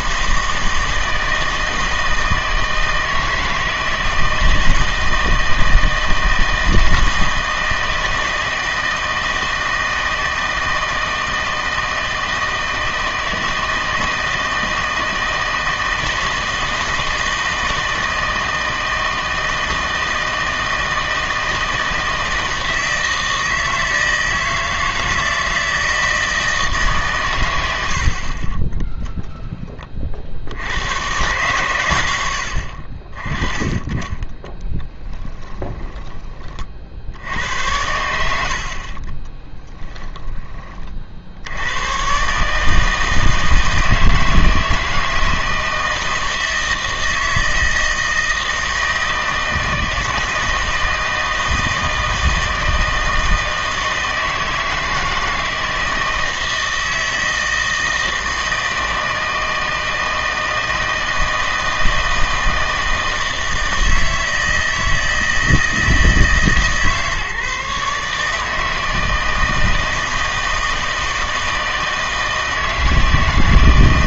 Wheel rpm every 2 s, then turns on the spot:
160, 160, 160, 160, 160, 160, 160, 160, 160, 160, 160, 160, 160, 150, 20, 90, 60, 20, 40, 60, 40, 150, 160, 160, 160, 160, 160, 160, 160, 160, 160, 160, 160, 150, 160, 160, 160.
34-36 38-40